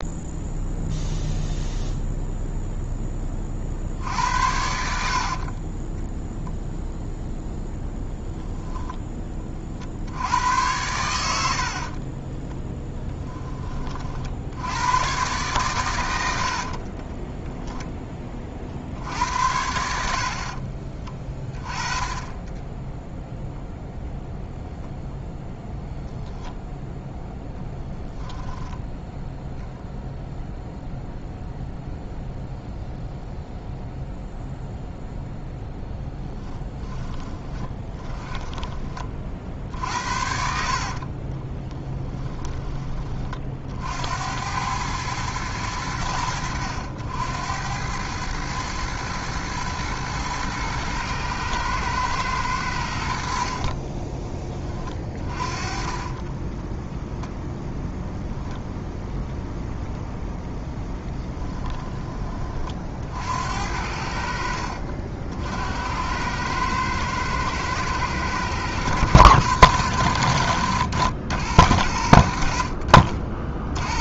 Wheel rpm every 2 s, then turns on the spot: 0, 10, 70, 0, 10, 100, 10, 100, 30, 60, 30, 0, 0, 0, 10, 0, 0, 0, 20, 30, 60, 20, 100, 80, 110, 110, 80, 20, 10, 0, 10, 50, 60, 110, 100, 100, 60.
12-14 16-18 20-22 36-38 40-42 54-58 60-62